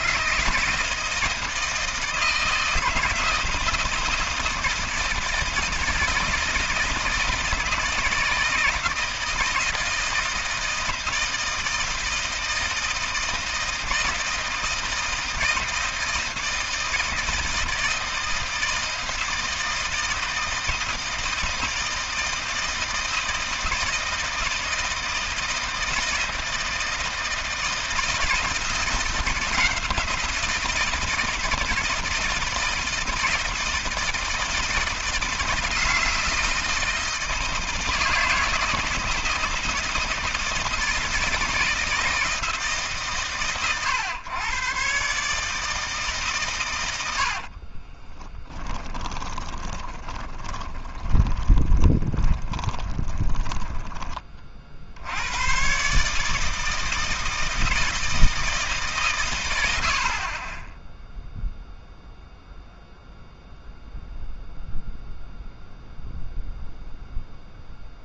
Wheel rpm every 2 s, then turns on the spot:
160, 160, 160, 160, 160, 160, 160, 160, 160, 160, 160, 160, 160, 160, 170, 160, 160, 160, 160, 160, 160, 140, 130, 90, 20, 20, 30, 80, 160, 140, 10, 0, 0, 0.
46-54